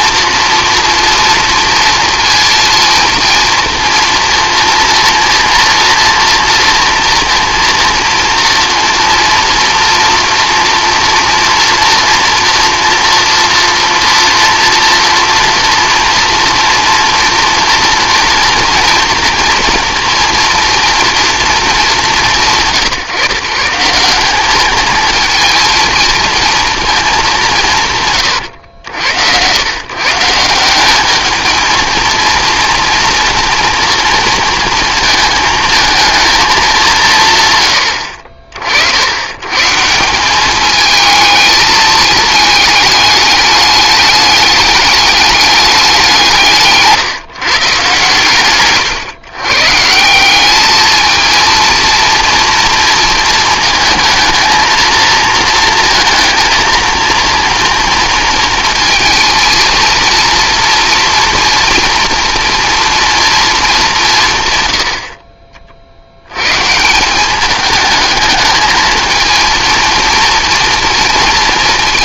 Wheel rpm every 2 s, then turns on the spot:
240, 230, 230, 230, 230, 240, 230, 230, 230, 230, 230, 140, 210, 230, 100, 190, 230, 230, 210, 60, 210, 210, 210, 160, 130, 210, 230, 220, 230, 230, 240, 230, 90, 150, 220, 230.
48-50